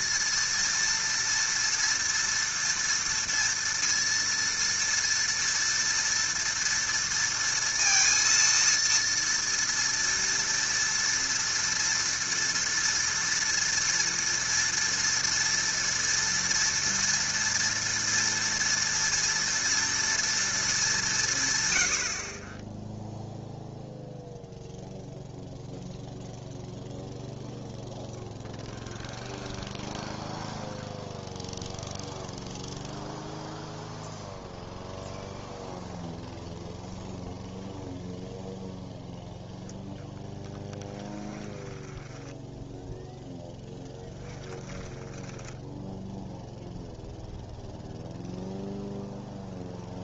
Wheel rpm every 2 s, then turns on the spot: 230, 230, 230, 230, 230, 230, 230, 230, 230, 230, 220, 20, 0, 0, 10, 10, 0, 0, 0, 0, 20, 10, 10, 0, 0.
28-32 40-46